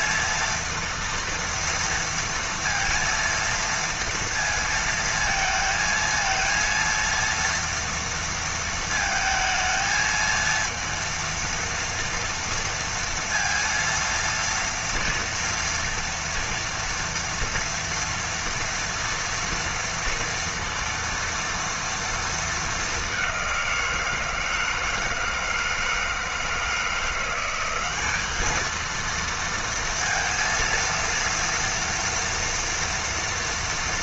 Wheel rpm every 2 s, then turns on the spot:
230, 230, 230, 230, 230, 230, 230, 230, 230, 230, 230, 210, 160, 160, 220, 230, 230.
none